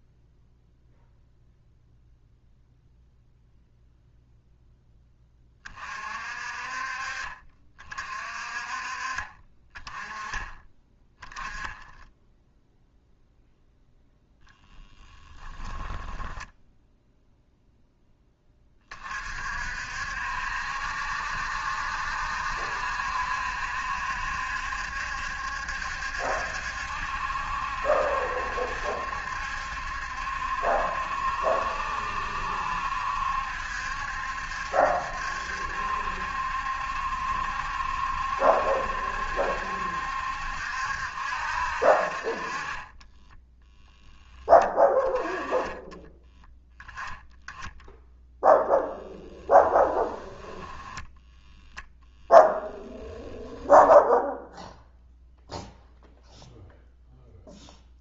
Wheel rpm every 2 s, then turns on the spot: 0, 0, 0, 40, 40, 10, 0, 10, 10, 20, 70, 70, 70, 70, 70, 70, 70, 70, 70, 70, 70, 30, 10, 10, 0, 20, 10, 10, 0.
14-18 42-44 50-54